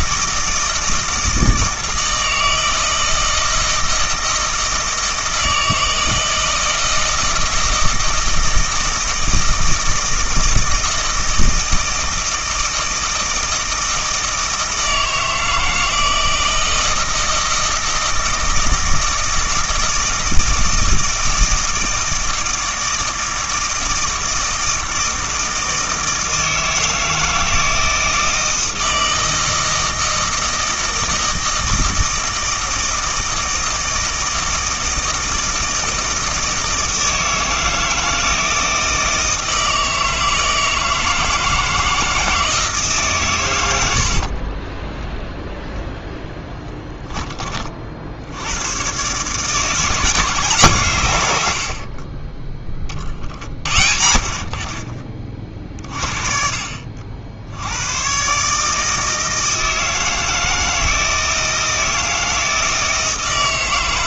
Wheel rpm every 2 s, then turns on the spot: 160, 160, 160, 160, 160, 160, 160, 160, 160, 160, 160, 160, 160, 160, 160, 160, 160, 160, 160, 160, 160, 150, 10, 10, 110, 140, 20, 40, 50, 150, 160, 160.
44-46